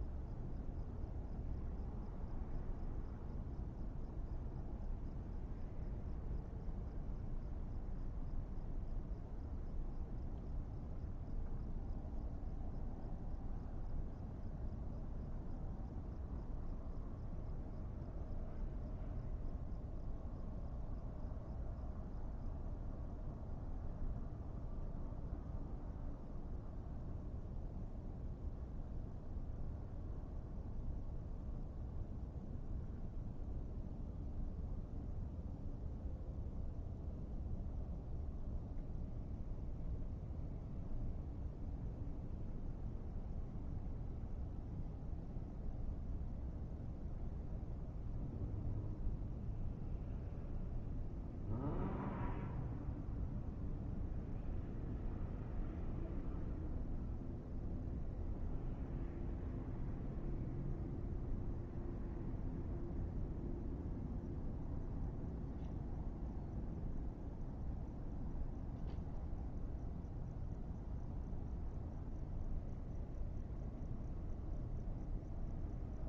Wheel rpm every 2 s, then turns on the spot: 0, 0, 0, 0, 0, 0, 0, 0, 0, 0, 0, 0, 0, 0, 0, 0, 0, 0, 0, 0, 0, 0, 0, 0, 0, 0, 0, 0, 0, 0, 0, 0, 0, 0, 0, 0, 0, 0.
none